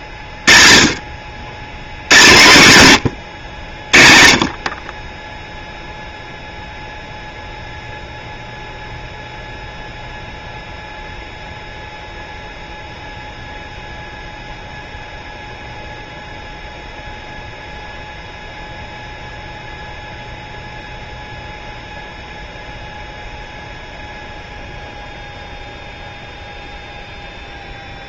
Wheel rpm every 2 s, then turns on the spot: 50, 110, 30, 0, 0, 0, 0, 0, 0, 0, 0, 0, 0, 0.
none